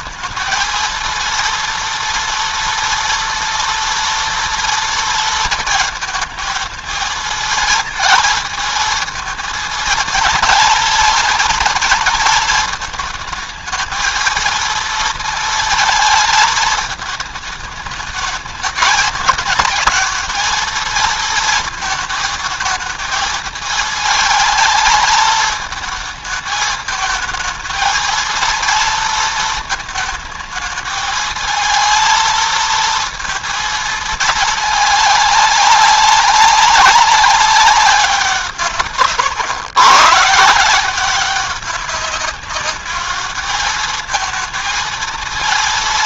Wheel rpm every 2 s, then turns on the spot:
230, 240, 230, 220, 220, 220, 220, 230, 220, 220, 230, 220, 220, 220, 230, 220, 230, 210, 200, 140, 180, 210, 230.
none